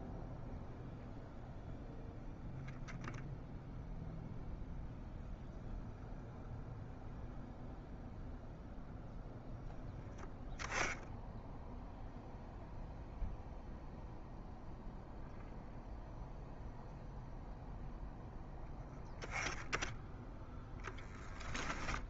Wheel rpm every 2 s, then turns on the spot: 0, 0, 0, 0, 0, 10, 0, 0, 0, 10, 10.
none